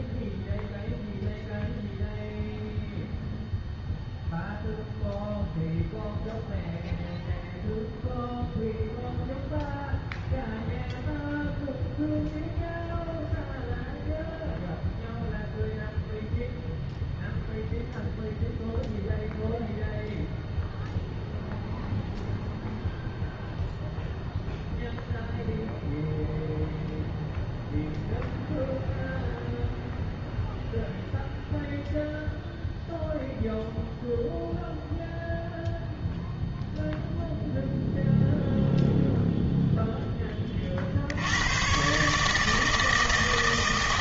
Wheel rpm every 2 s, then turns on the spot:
0, 0, 0, 0, 0, 0, 0, 0, 0, 0, 0, 0, 0, 0, 0, 0, 0, 0, 0, 0, 40, 160.
none